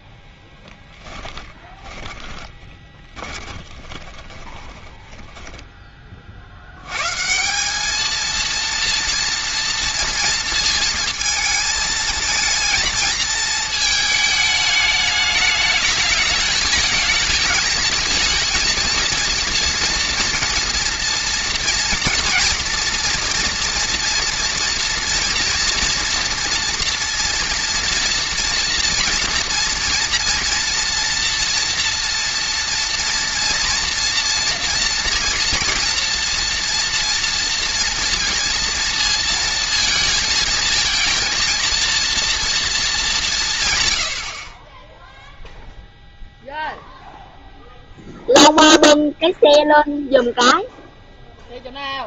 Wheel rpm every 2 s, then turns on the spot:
10, 20, 20, 80, 230, 230, 220, 210, 220, 230, 230, 230, 230, 230, 240, 230, 230, 230, 230, 230, 230, 230, 30, 0, 0, 0.
0-6